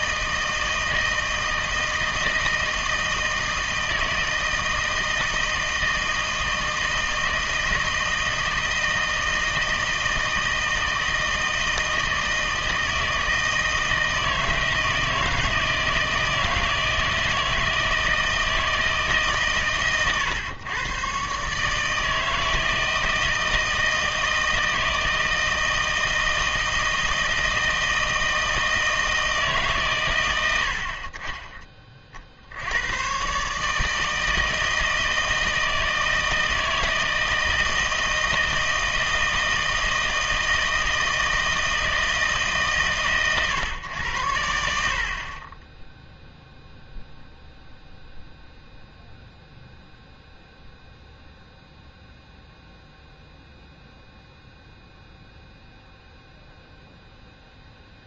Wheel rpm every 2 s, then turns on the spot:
160, 160, 160, 160, 160, 160, 160, 160, 160, 160, 130, 160, 160, 160, 160, 90, 70, 160, 160, 160, 160, 140, 80, 0, 0, 0, 0, 0, 0.
none